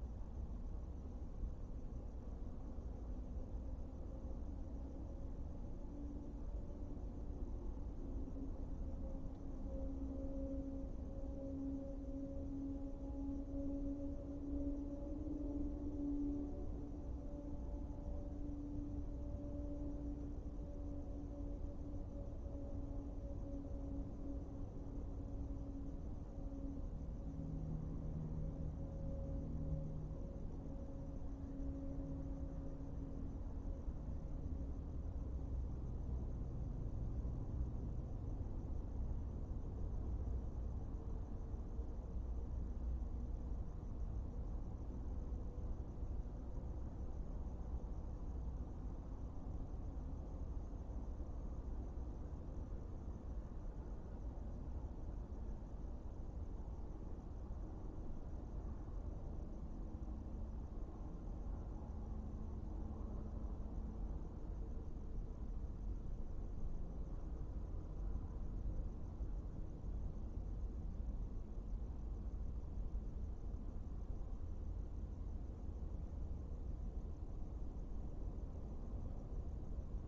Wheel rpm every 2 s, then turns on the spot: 0, 0, 0, 0, 0, 0, 0, 0, 0, 0, 0, 0, 0, 0, 0, 0, 0, 0, 0, 0, 0, 0, 0, 0, 0, 0, 0, 0, 0, 0, 0, 0, 0, 0, 0, 0, 0, 0, 0, 0.
none